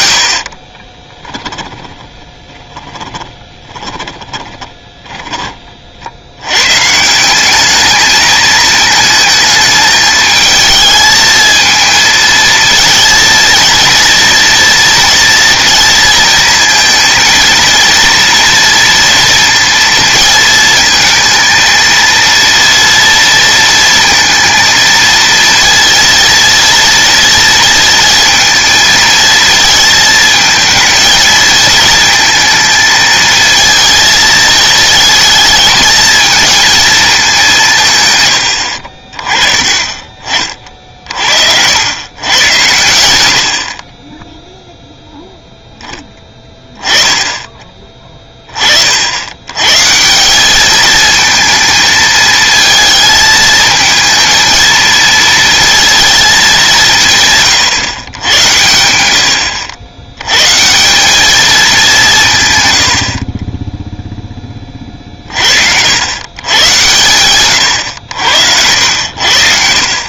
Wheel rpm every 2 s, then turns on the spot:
30, 20, 20, 120, 220, 220, 230, 230, 220, 230, 220, 230, 230, 230, 230, 220, 230, 220, 220, 60, 40, 90, 0, 10, 40, 210, 220, 230, 190, 90, 160, 110, 20, 120, 90.
0-6 38-40